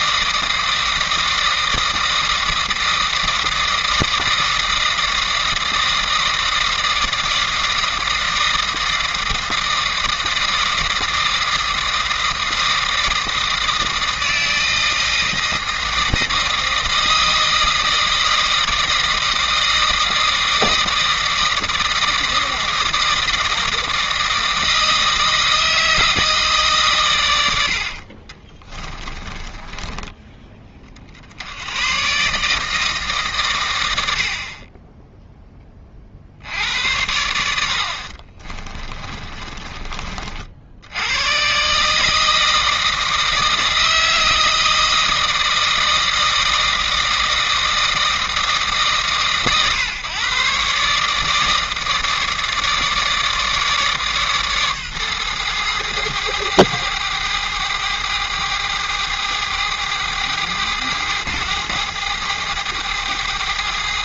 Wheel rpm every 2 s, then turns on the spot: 160, 160, 160, 160, 160, 160, 160, 160, 160, 160, 160, 160, 160, 150, 20, 30, 150, 20, 80, 30, 70, 160, 160, 160, 130, 140, 160, 140, 110, 110, 100, 110.
28-30 38-40